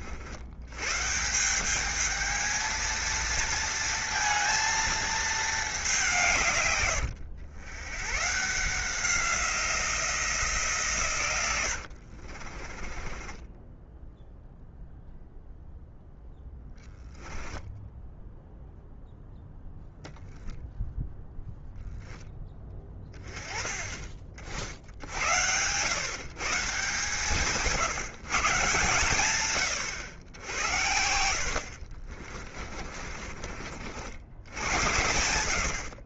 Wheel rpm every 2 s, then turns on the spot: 120, 220, 230, 110, 170, 140, 30, 0, 10, 0, 0, 20, 60, 150, 150, 70, 40, 80.
12-14 32-34